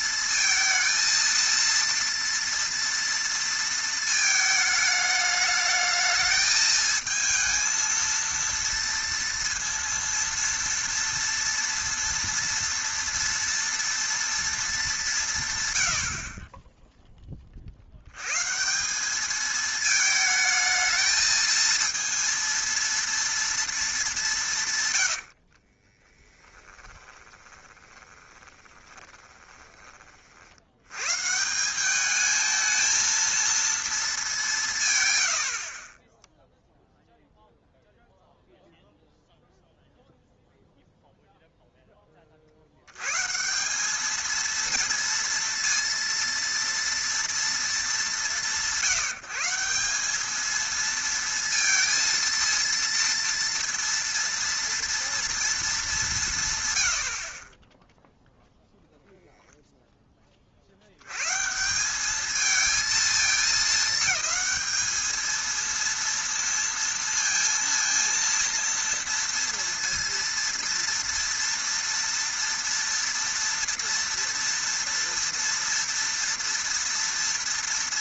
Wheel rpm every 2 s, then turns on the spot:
230, 230, 220, 220, 230, 230, 230, 170, 0, 180, 220, 230, 150, 10, 20, 80, 220, 190, 0, 0, 0, 70, 230, 230, 120, 220, 230, 230, 130, 0, 50, 220, 210, 230, 230, 230, 230, 230, 230.
26-30